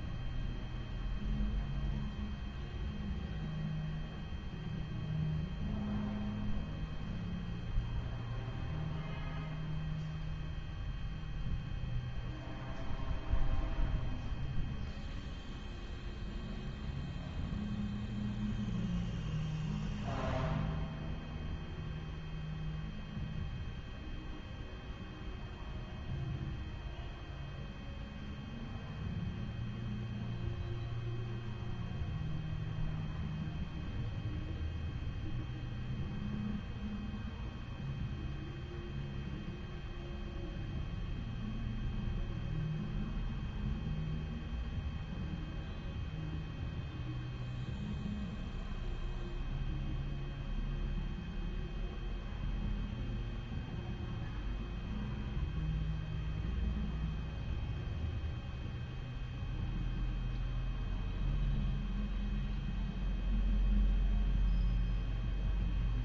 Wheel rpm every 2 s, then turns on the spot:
0, 0, 0, 0, 0, 0, 0, 0, 0, 0, 0, 0, 0, 0, 0, 0, 0, 0, 0, 0, 0, 0, 0, 0, 0, 0, 0, 0, 0, 0, 0, 0, 0.
none